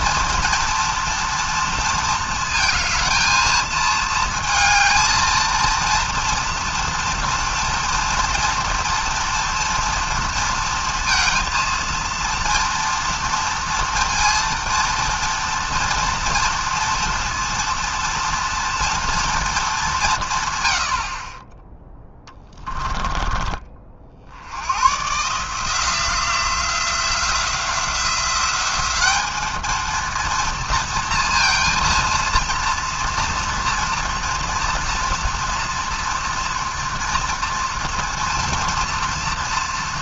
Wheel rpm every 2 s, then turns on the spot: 230, 230, 220, 230, 230, 230, 230, 230, 230, 230, 100, 20, 100, 170, 190, 230, 230, 240, 240, 230.
none